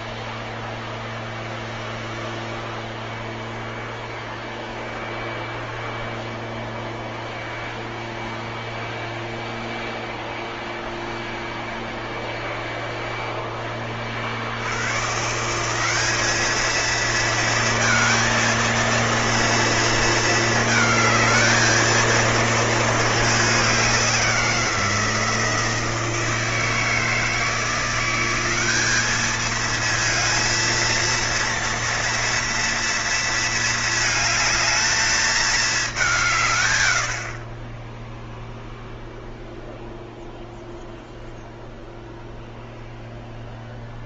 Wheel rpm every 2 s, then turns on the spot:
0, 0, 0, 0, 0, 0, 0, 110, 220, 230, 220, 230, 170, 160, 200, 230, 230, 220, 120, 0, 0, 0.
none